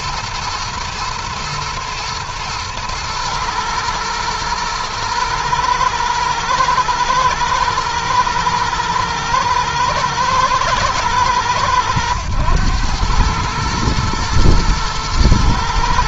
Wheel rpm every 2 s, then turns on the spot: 120, 120, 110, 110, 110, 110, 110, 110.
none